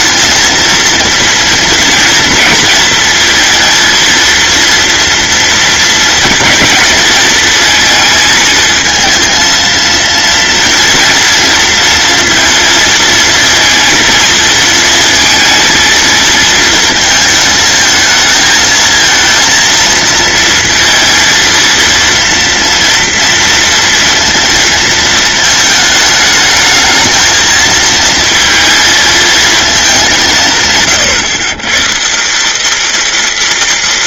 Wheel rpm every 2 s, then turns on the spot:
230, 220, 230, 230, 230, 230, 230, 230, 230, 220, 230, 230, 220, 220, 230, 130, 230.
none